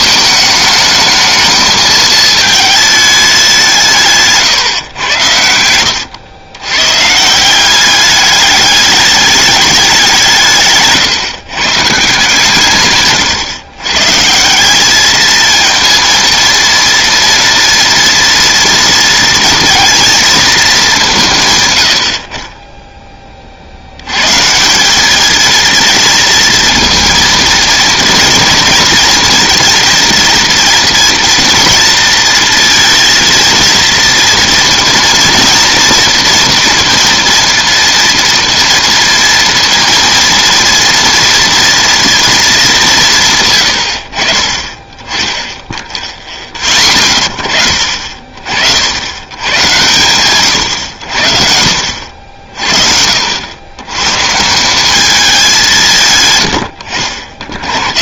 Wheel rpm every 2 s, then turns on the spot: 210, 220, 150, 120, 210, 140, 150, 180, 230, 230, 220, 30, 170, 230, 230, 230, 230, 230, 230, 230, 230, 210, 30, 20, 60, 100, 60, 170, 100.
none